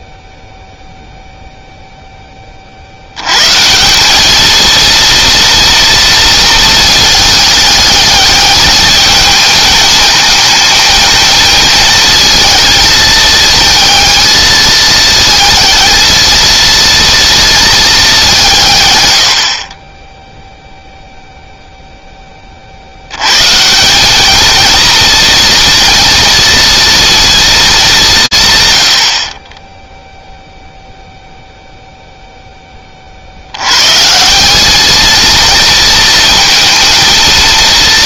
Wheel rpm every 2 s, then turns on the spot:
0, 60, 230, 220, 210, 220, 220, 220, 230, 130, 0, 100, 230, 230, 40, 0, 90, 230, 220.
none